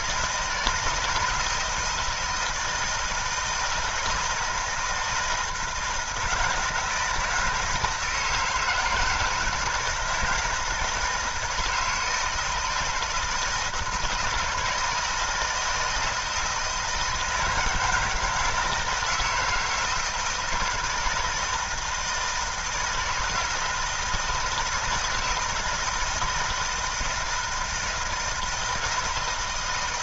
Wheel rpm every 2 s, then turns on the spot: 170, 160, 160, 160, 160, 160, 160, 160, 160, 160, 160, 160, 160, 160, 160.
none